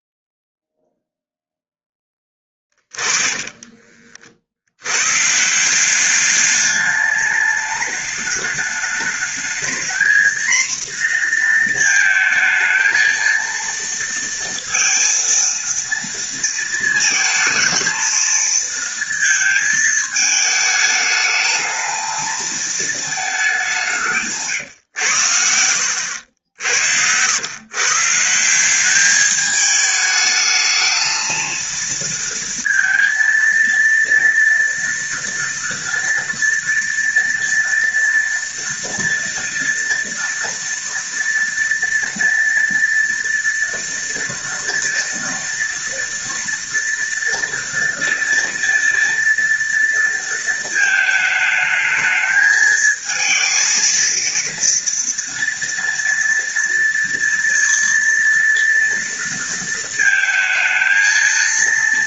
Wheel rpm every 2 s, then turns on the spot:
0, 20, 80, 210, 210, 240, 220, 230, 230, 230, 220, 220, 120, 80, 190, 220, 230, 230, 230, 240, 230, 230, 230, 230, 230, 220, 220, 230, 230, 230, 230.
2-4